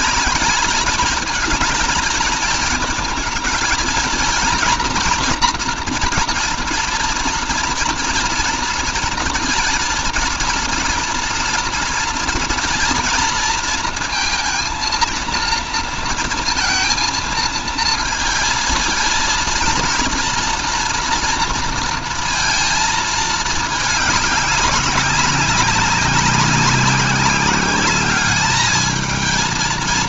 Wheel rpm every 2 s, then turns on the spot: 220, 220, 230, 230, 230, 230, 230, 230, 230, 220, 240, 230, 200, 190, 220.
none